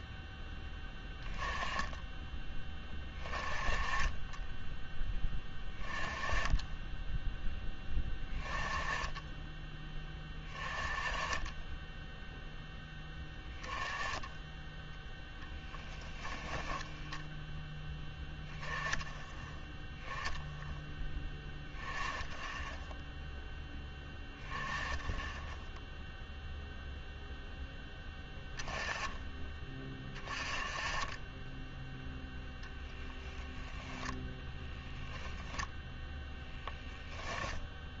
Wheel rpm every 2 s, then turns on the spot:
10, 20, 10, 10, 20, 20, 0, 10, 10, 10, 0, 10, 10, 0, 10, 20, 0, 0, 0.
16-18